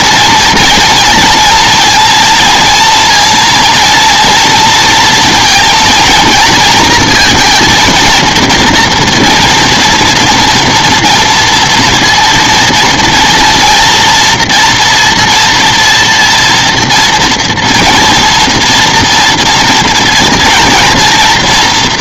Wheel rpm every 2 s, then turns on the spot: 230, 230, 230, 230, 230, 230, 240, 230, 230, 230, 230.
none